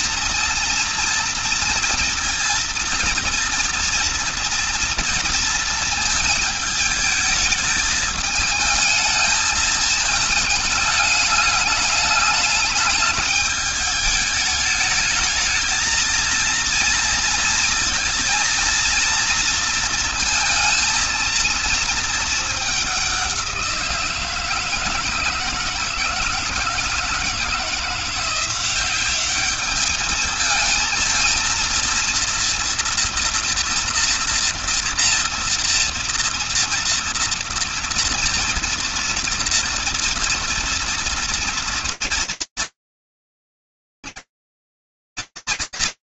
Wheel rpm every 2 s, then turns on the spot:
230, 230, 230, 220, 220, 220, 210, 210, 230, 230, 230, 200, 160, 170, 190, 220, 230, 230, 230, 230, 230, 230, 240.
none